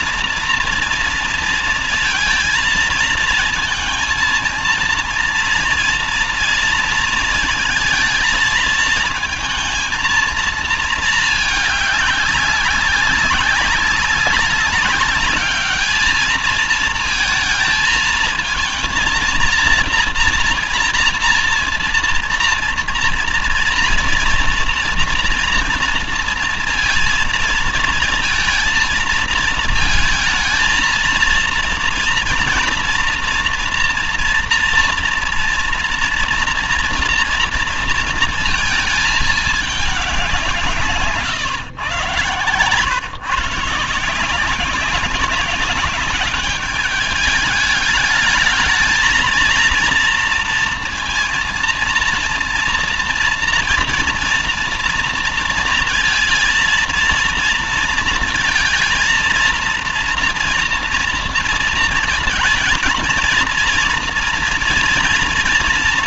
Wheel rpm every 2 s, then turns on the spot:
230, 230, 230, 230, 230, 220, 200, 200, 220, 230, 230, 230, 240, 230, 230, 220, 230, 230, 230, 220, 150, 120, 190, 210, 220, 230, 230, 230, 230, 230, 230, 230, 230.
none